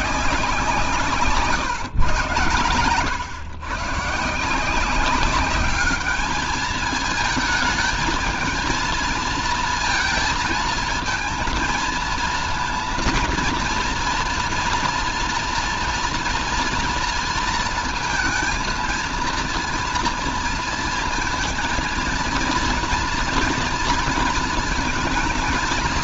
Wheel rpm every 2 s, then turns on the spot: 180, 110, 160, 210, 220, 230, 220, 230, 230, 230, 230, 230, 230.
none